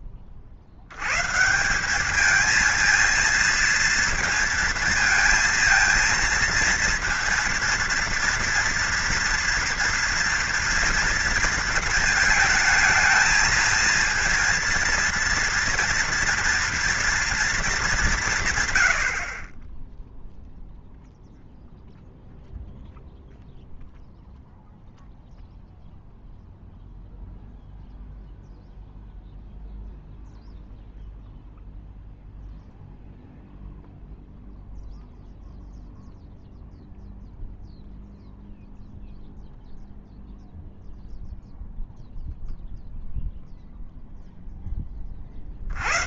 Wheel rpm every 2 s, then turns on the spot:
70, 220, 230, 230, 230, 230, 220, 230, 230, 130, 0, 0, 0, 0, 0, 0, 0, 0, 0, 0, 0, 0, 10.
none